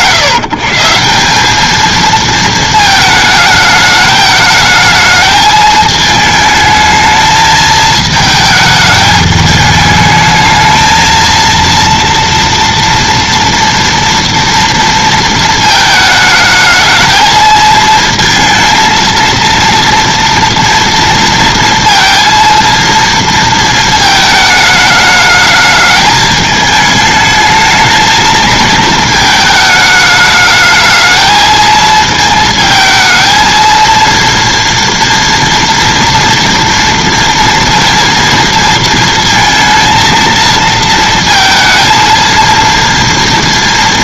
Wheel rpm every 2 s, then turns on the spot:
150, 220, 220, 220, 210, 220, 230, 230, 220, 230, 230, 230, 210, 220, 220, 220, 220, 230, 230, 230, 230, 230.
none